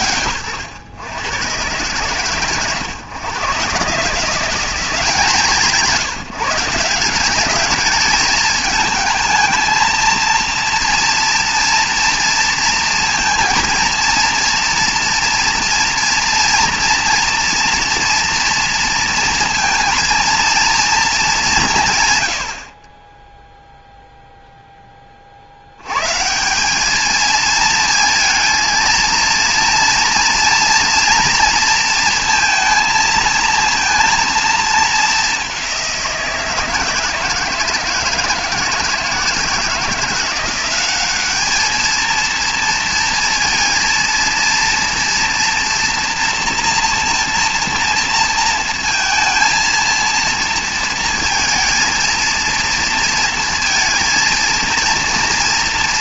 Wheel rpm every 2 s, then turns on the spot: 120, 130, 180, 170, 210, 230, 230, 230, 230, 230, 230, 50, 10, 190, 230, 230, 230, 220, 160, 160, 190, 230, 230, 230, 230, 230, 230, 230.
none